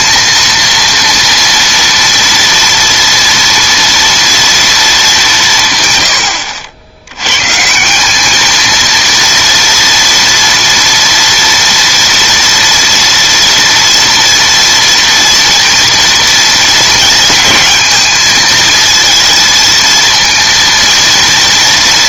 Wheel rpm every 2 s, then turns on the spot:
230, 230, 230, 80, 220, 240, 230, 230, 230, 230, 230.
none